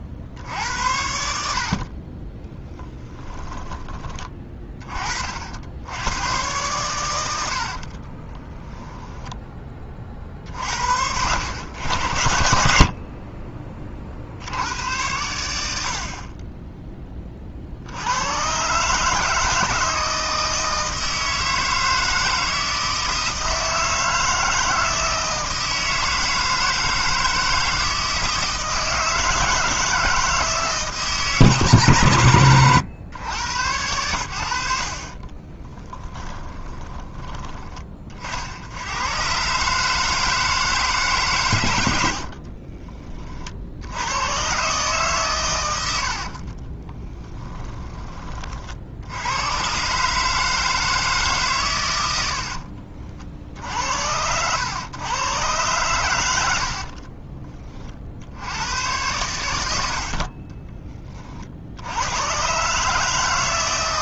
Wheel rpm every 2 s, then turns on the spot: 80, 10, 30, 100, 20, 70, 60, 90, 20, 140, 160, 160, 160, 160, 160, 160, 110, 60, 20, 80, 160, 30, 130, 30, 50, 160, 60, 110, 50, 110, 20, 140.
8-10 36-38 42-44 46-48 52-54 56-58